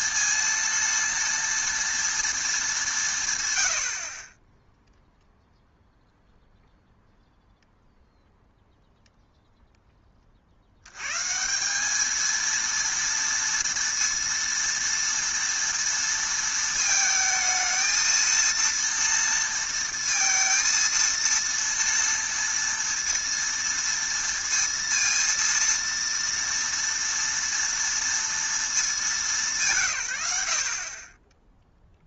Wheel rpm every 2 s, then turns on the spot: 230, 220, 10, 0, 0, 60, 230, 230, 230, 230, 230, 230, 230, 230, 230, 80.
none